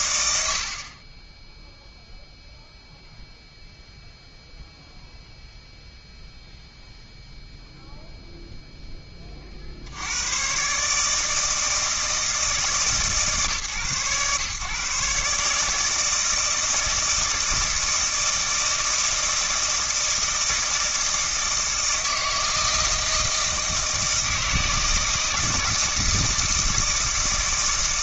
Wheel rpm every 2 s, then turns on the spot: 70, 0, 0, 0, 0, 120, 150, 130, 160, 160, 160, 160, 160, 160.
none